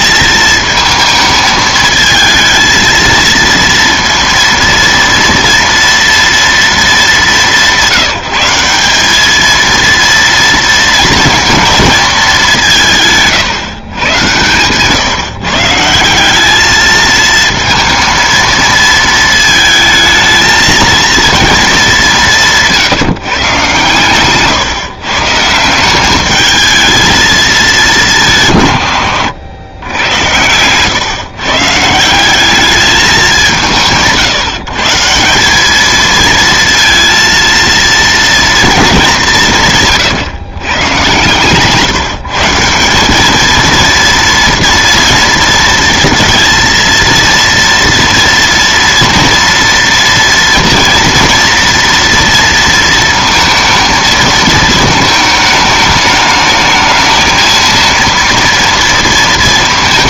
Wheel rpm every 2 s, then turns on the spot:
220, 220, 230, 220, 180, 230, 190, 120, 210, 230, 220, 170, 130, 220, 130, 120, 200, 150, 230, 230, 130, 170, 230, 230, 230, 230, 230, 220, 220, 230.
22-24